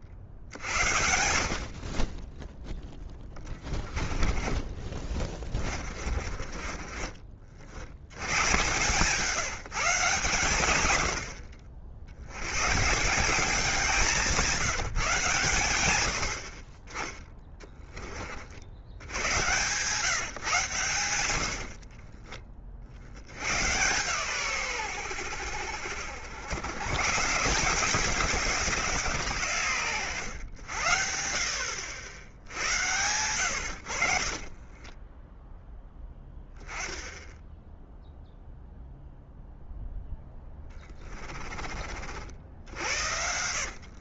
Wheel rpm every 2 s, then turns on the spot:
80, 10, 20, 30, 130, 90, 150, 160, 30, 80, 120, 50, 100, 130, 170, 80, 90, 20, 10, 0, 20, 90.
2-8 34-36 40-44